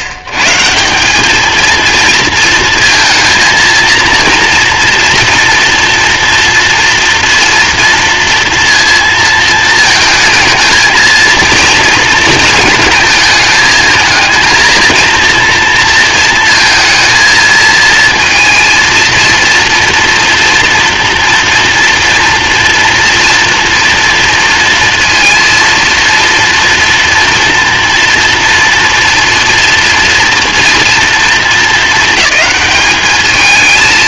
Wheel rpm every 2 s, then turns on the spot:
140, 230, 230, 230, 230, 220, 220, 230, 230, 230, 240, 230, 230, 240, 230, 240, 210.
none